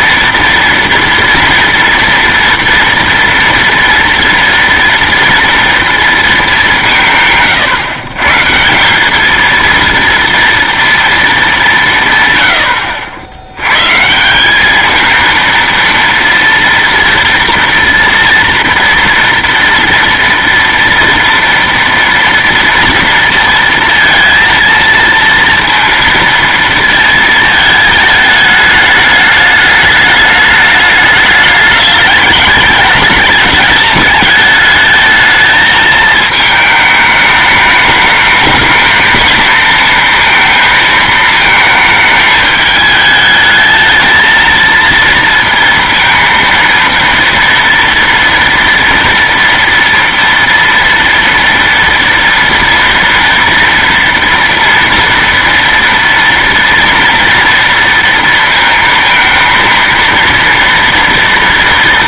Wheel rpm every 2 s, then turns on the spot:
230, 230, 230, 210, 150, 230, 90, 200, 230, 230, 230, 230, 230, 230, 210, 210, 210, 210, 220, 220, 230, 210, 230, 230, 230, 230, 230, 230, 230, 230, 230.
none